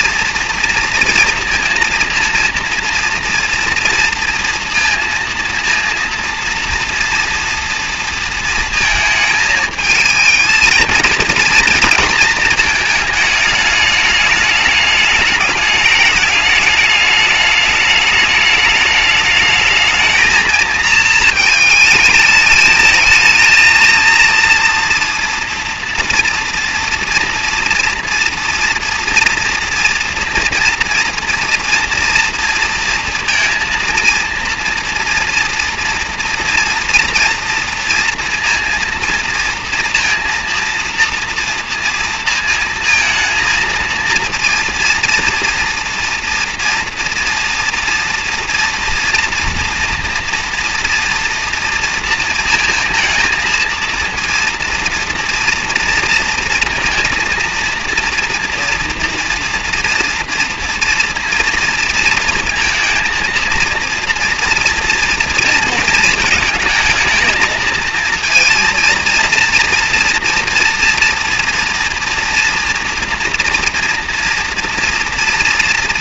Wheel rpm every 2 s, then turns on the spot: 230, 230, 230, 230, 230, 220, 220, 210, 210, 210, 230, 220, 230, 230, 230, 230, 230, 230, 230, 230, 230, 230, 230, 230, 230, 230, 230, 230, 230, 230, 230, 230, 230, 220, 230, 240, 230, 230.
none